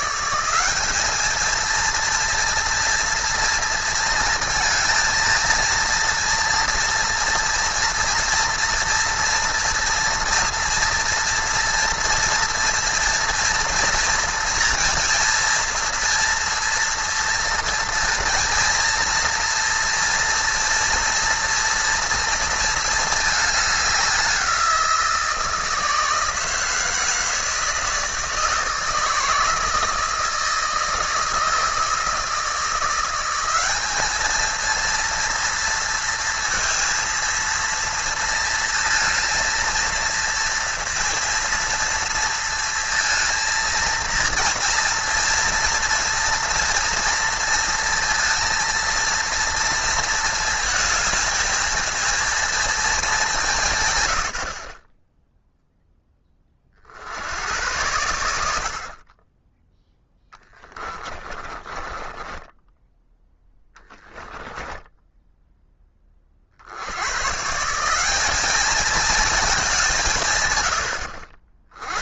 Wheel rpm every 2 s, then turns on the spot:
200, 230, 230, 230, 230, 230, 230, 230, 230, 230, 230, 230, 180, 160, 160, 160, 170, 230, 230, 230, 230, 230, 230, 230, 230, 220, 230, 40, 60, 50, 20, 10, 10, 80, 220, 100.
60-62 64-66